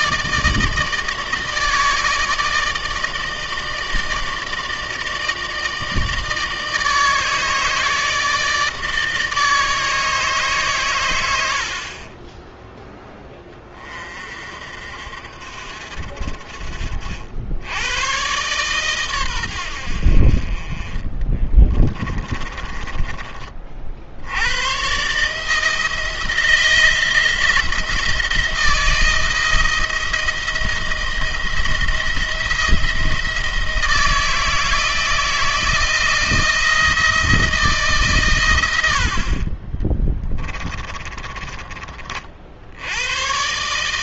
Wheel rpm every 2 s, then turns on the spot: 160, 160, 160, 160, 160, 140, 10, 50, 50, 120, 30, 30, 110, 160, 160, 160, 170, 160, 160, 100, 20, 70.
22-24 40-42